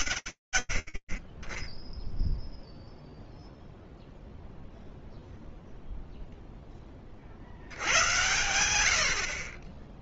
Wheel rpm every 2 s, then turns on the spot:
0, 0, 0, 90, 10.
none